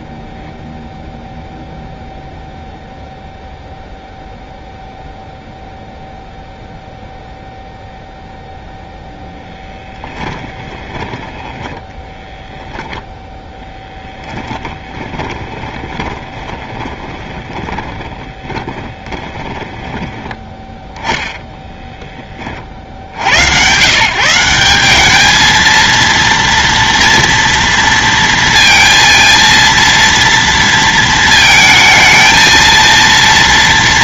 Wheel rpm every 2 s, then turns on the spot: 0, 0, 0, 0, 10, 10, 0, 20, 10, 10, 10, 110, 210, 230, 230, 220, 230.
8-10 14-20